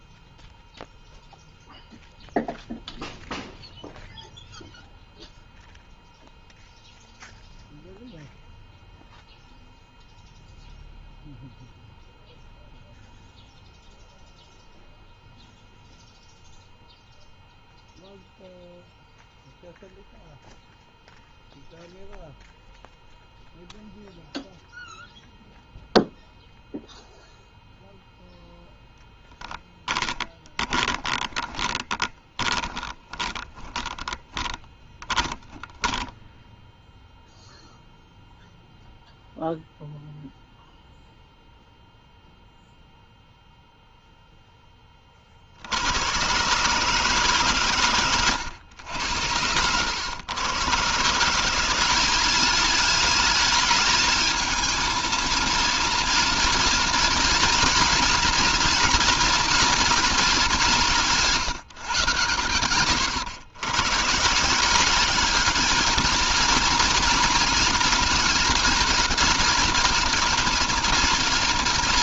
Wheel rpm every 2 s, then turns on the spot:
0, 0, 0, 0, 0, 0, 0, 0, 0, 0, 0, 0, 0, 0, 0, 10, 20, 20, 0, 0, 0, 0, 30, 140, 90, 150, 220, 230, 230, 230, 180, 110, 200, 230, 220, 230.
30-34